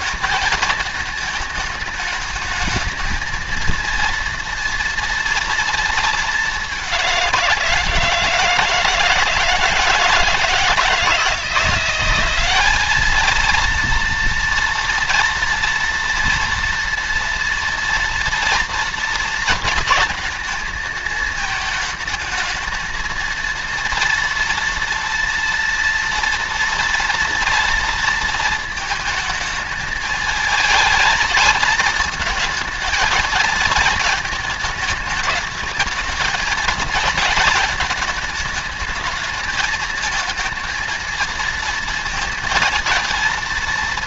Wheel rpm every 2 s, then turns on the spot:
220, 220, 230, 200, 160, 160, 200, 230, 230, 230, 220, 220, 230, 230, 220, 220, 230, 220, 220, 220, 230, 230.
none